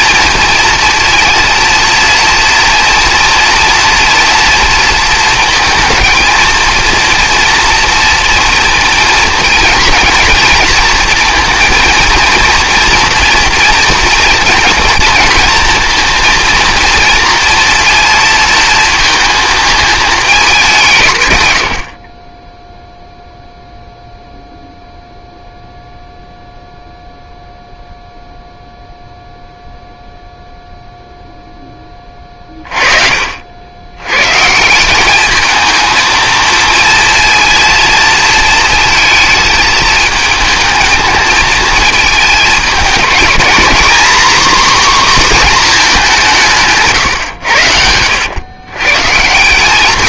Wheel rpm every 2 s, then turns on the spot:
230, 230, 230, 230, 230, 230, 230, 230, 230, 230, 170, 0, 0, 0, 0, 0, 40, 190, 230, 230, 220, 210, 260, 150, 140.
46-48